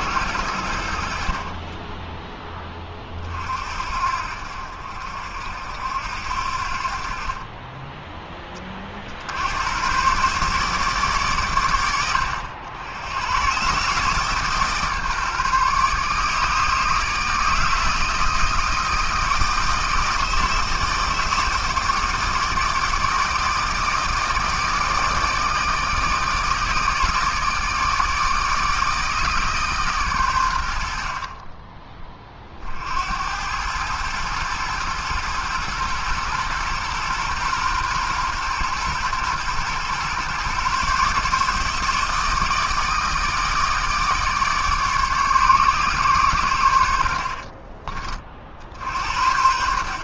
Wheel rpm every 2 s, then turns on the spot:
70, 30, 60, 50, 50, 150, 100, 150, 160, 160, 160, 160, 160, 160, 160, 80, 60, 110, 120, 120, 140, 160, 140, 70, 70.
none